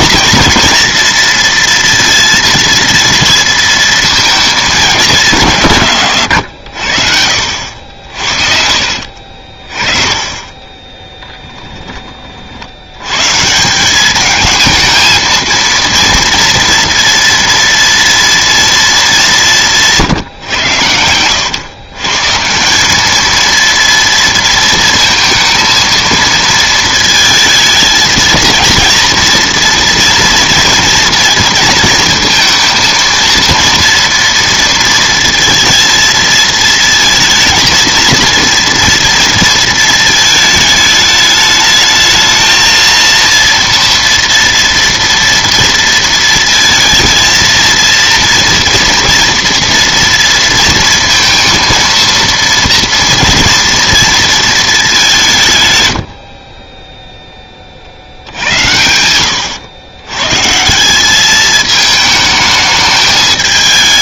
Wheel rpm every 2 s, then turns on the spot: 230, 230, 210, 90, 50, 20, 80, 220, 230, 230, 110, 190, 230, 230, 230, 230, 230, 230, 220, 230, 220, 230, 230, 230, 230, 230, 230, 210, 20, 80, 160, 220.
8-12 56-58